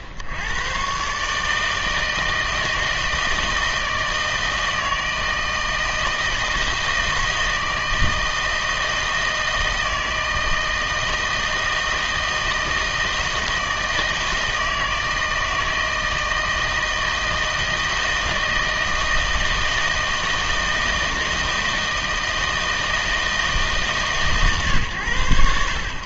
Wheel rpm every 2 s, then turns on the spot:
110, 160, 160, 160, 160, 160, 160, 160, 160, 160, 160, 160, 120.
none